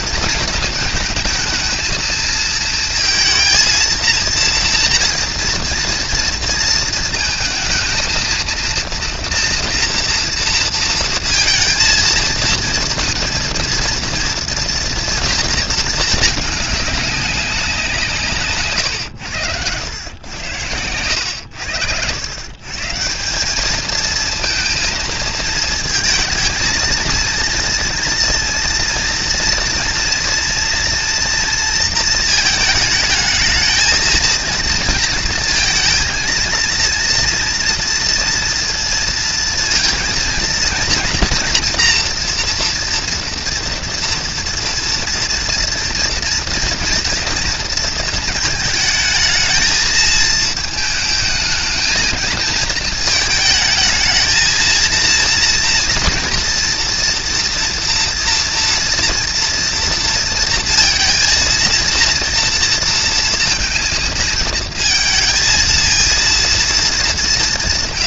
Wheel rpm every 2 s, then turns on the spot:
220, 230, 230, 230, 230, 230, 230, 230, 210, 130, 90, 140, 230, 220, 230, 230, 220, 230, 230, 230, 230, 230, 230, 230, 220, 220, 220, 220, 230, 230, 230, 230, 230, 230.
none